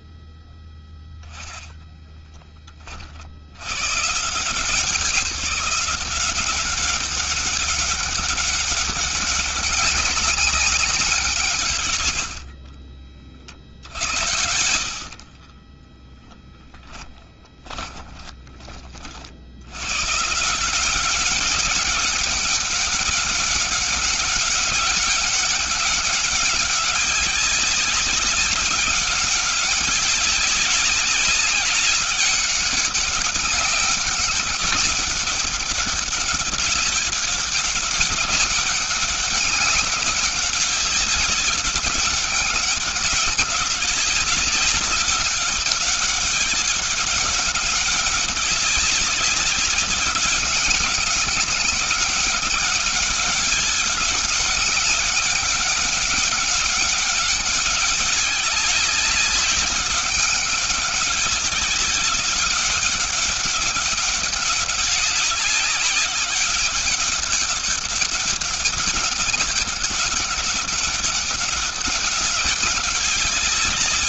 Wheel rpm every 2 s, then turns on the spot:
0, 40, 160, 190, 190, 180, 40, 70, 30, 50, 180, 200, 200, 190, 190, 200, 200, 200, 200, 200, 190, 200, 190, 200, 200, 200, 200, 200, 200, 200, 200, 200, 190, 200, 200, 200, 200.
14-18